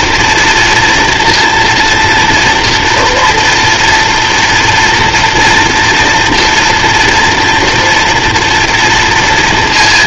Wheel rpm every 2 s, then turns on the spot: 230, 240, 230, 230, 240.
none